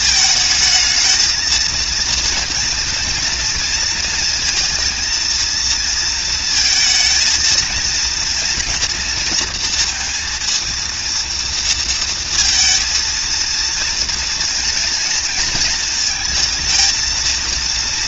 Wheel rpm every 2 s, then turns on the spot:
220, 230, 230, 220, 230, 230, 230, 230, 230.
none